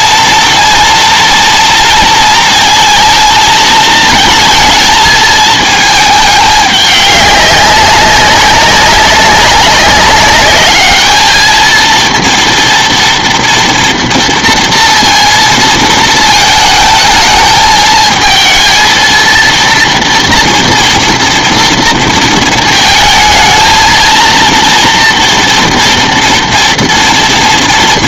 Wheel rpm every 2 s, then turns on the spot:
230, 230, 220, 210, 190, 210, 230, 230, 220, 230, 230, 220, 240, 230.
none